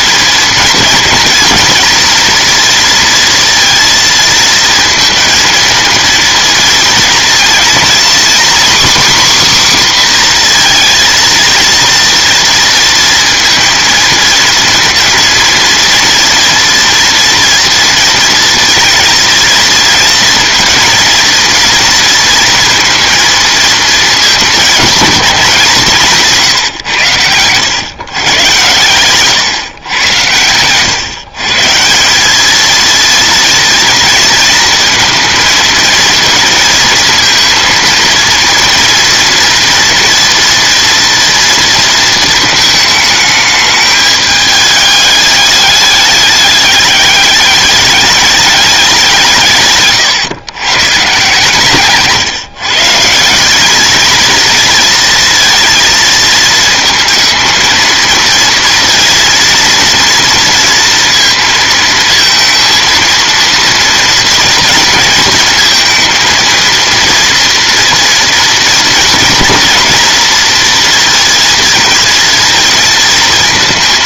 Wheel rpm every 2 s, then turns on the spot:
230, 230, 220, 230, 260, 240, 230, 230, 230, 230, 230, 230, 210, 150, 110, 110, 220, 230, 230, 230, 240, 220, 210, 200, 200, 140, 150, 230, 230, 230, 230, 230, 230, 230, 230, 230, 230.
none